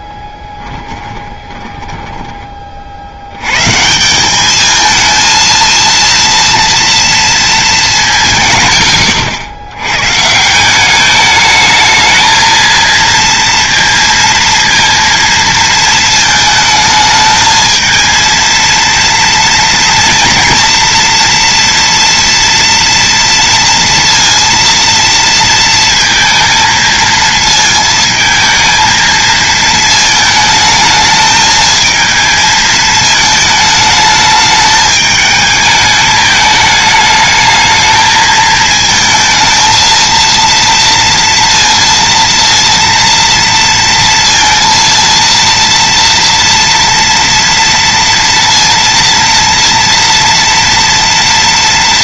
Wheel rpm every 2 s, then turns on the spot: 10, 60, 220, 230, 110, 200, 230, 230, 220, 230, 240, 230, 230, 230, 230, 220, 220, 210, 210, 220, 230, 230, 230, 240, 230, 230.
0-2